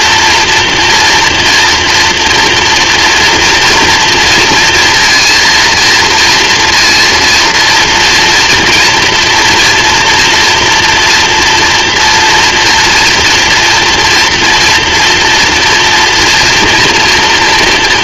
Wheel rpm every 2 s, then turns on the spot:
240, 230, 230, 230, 230, 230, 230, 230, 230.
none